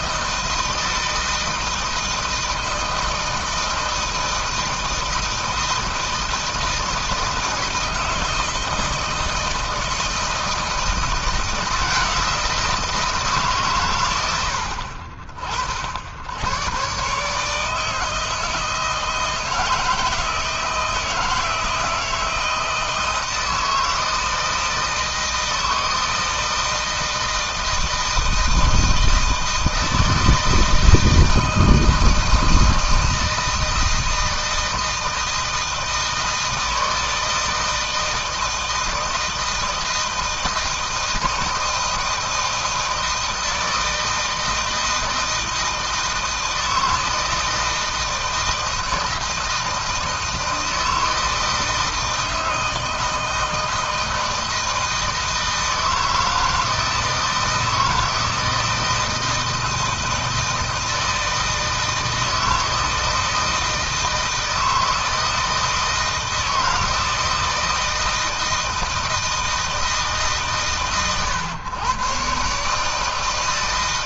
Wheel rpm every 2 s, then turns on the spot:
160, 160, 160, 160, 160, 170, 150, 60, 140, 160, 160, 160, 160, 160, 160, 160, 160, 160, 160, 160, 160, 160, 160, 160, 160, 160, 160, 160, 160, 160, 160, 160, 160, 170, 160, 130, 160.
none